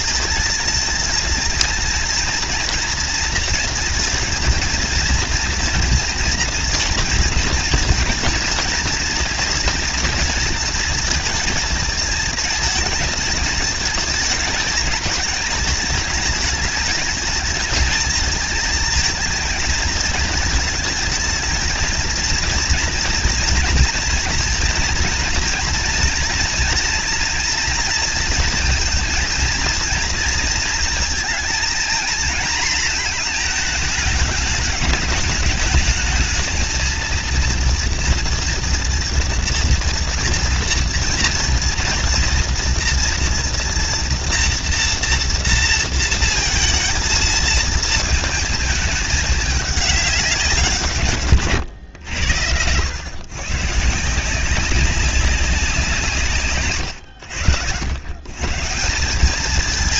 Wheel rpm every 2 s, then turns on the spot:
230, 240, 230, 230, 230, 230, 220, 220, 220, 220, 230, 230, 230, 230, 230, 230, 230, 210, 220, 230, 230, 230, 240, 230, 220, 190, 100, 170, 140, 130.
none